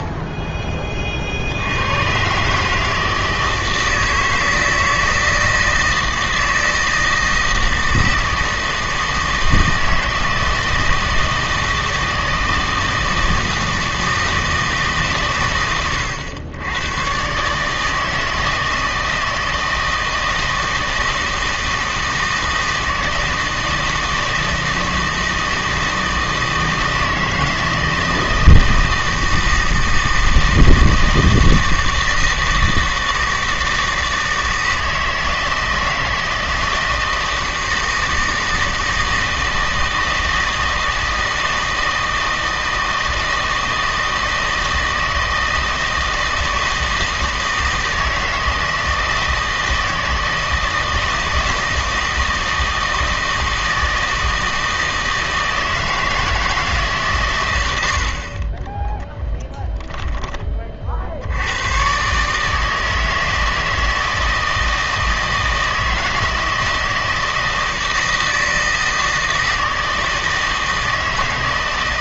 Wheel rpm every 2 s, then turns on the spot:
10, 130, 160, 160, 160, 160, 160, 160, 100, 160, 160, 160, 160, 160, 160, 160, 160, 160, 160, 160, 160, 160, 160, 160, 160, 160, 160, 160, 160, 40, 20, 150, 160, 160, 160, 160.
58-60